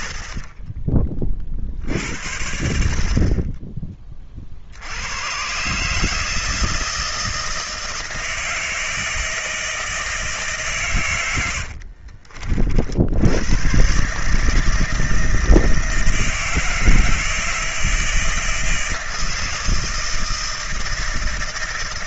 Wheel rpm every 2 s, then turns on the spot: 60, 60, 30, 150, 160, 160, 60, 150, 160, 160, 160.
none